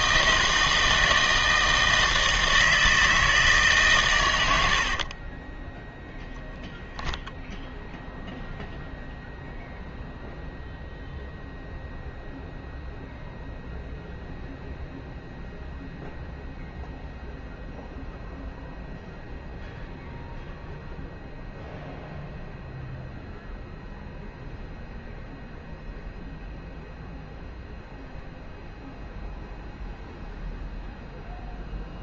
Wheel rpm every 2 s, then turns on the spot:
160, 160, 80, 0, 0, 0, 0, 0, 0, 0, 0, 0, 0, 0, 0, 0.
4-6